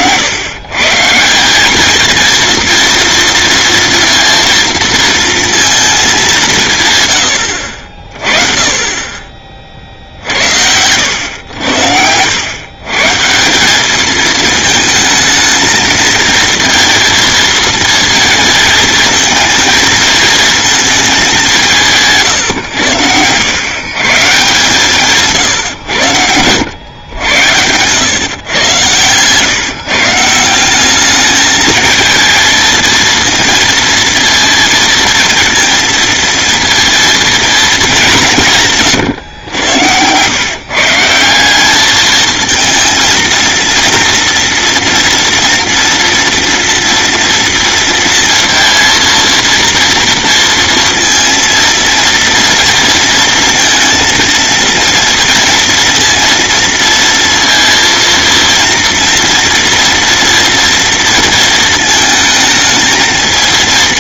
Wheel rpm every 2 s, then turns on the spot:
150, 230, 230, 150, 30, 80, 130, 220, 230, 230, 220, 100, 150, 90, 120, 200, 230, 230, 230, 140, 160, 230, 230, 230, 230, 230, 230, 230, 230, 230, 230, 220.
24-26